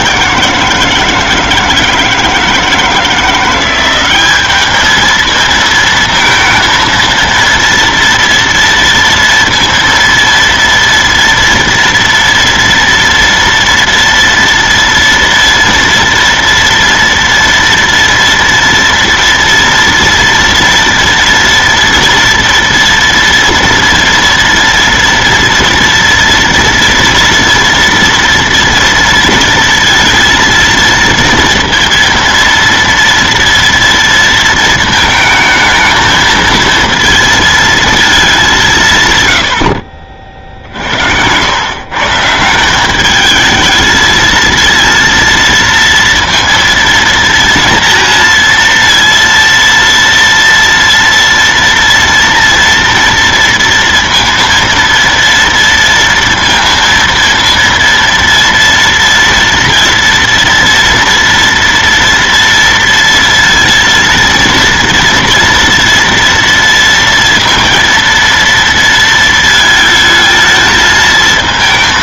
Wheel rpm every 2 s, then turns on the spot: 170, 160, 210, 230, 230, 230, 230, 230, 230, 230, 230, 230, 230, 230, 230, 230, 230, 220, 230, 170, 60, 190, 230, 230, 230, 230, 230, 230, 230, 230, 230, 230, 230, 230, 230, 220.
none